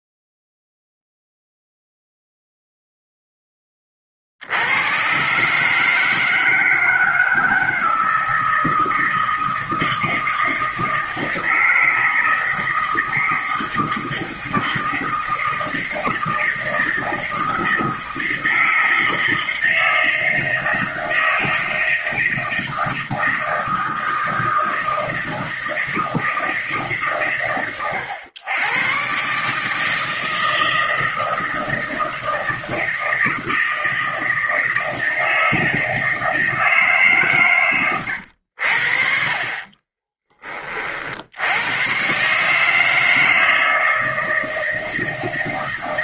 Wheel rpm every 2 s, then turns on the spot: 0, 10, 120, 160, 160, 160, 160, 160, 160, 160, 160, 160, 160, 130, 130, 160, 160, 160, 140, 50, 60, 160, 160.
none